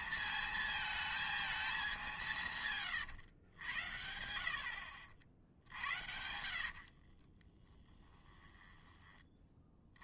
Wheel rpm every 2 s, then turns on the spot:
230, 150, 70, 80, 10.
2-10